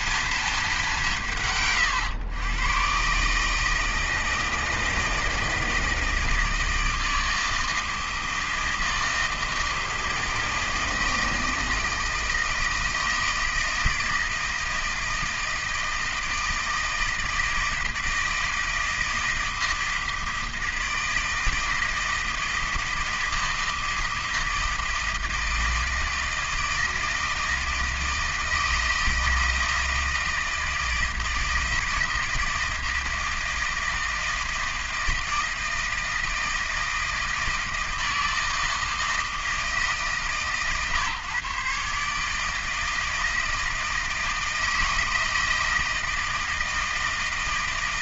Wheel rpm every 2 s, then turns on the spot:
200, 120, 160, 160, 160, 160, 160, 160, 160, 160, 160, 160, 160, 160, 160, 160, 160, 160, 160, 160, 140, 160, 160, 160.
none